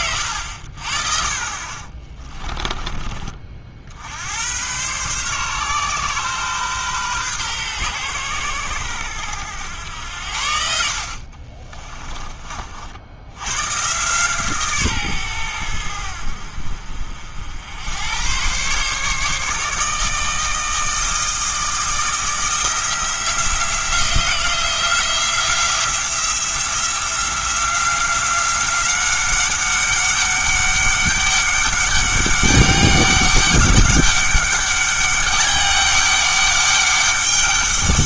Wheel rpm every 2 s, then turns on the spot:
70, 30, 110, 130, 100, 70, 50, 140, 60, 130, 160, 170, 170, 170, 190, 200, 200, 200, 200.
2-4 10-12